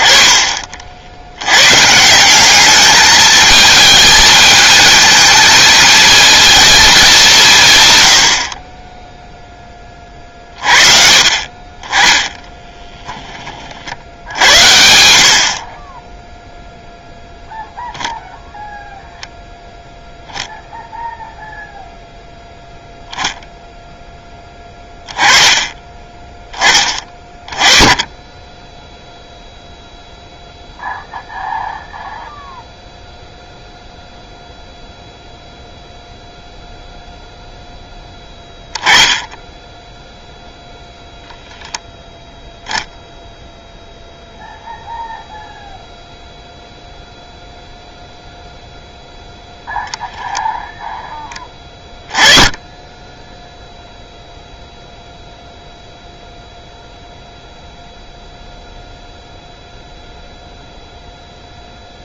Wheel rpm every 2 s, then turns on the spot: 40, 200, 220, 220, 30, 40, 10, 70, 0, 0, 10, 0, 10, 10, 10, 0, 0, 0, 0, 10, 0, 0, 0, 0, 0, 0, 20, 0, 0, 0, 0.
12-14